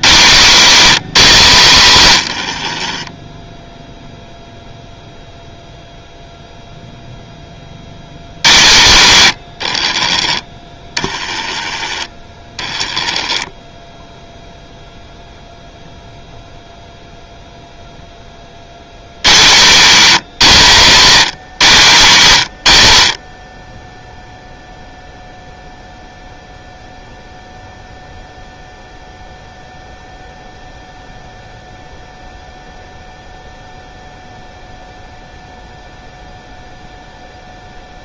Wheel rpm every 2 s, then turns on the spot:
190, 60, 0, 0, 120, 20, 20, 0, 0, 70, 180, 110, 0, 0, 0, 0, 0, 0, 0.
2-4 12-14